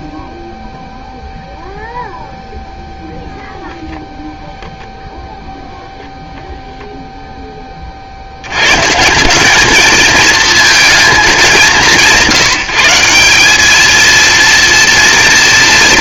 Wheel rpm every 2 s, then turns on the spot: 0, 0, 0, 0, 110, 220, 180, 230.
none